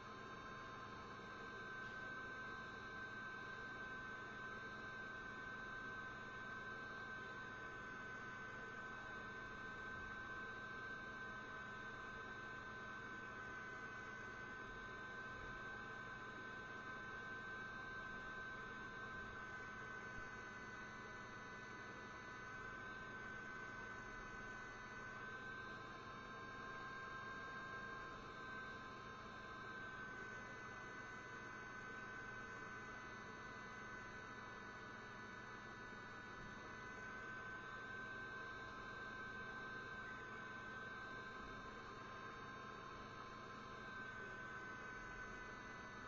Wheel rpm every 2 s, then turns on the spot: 0, 0, 0, 0, 0, 0, 0, 0, 0, 0, 0, 0, 0, 0, 0, 0, 0, 0, 0, 0, 0, 0, 0.
none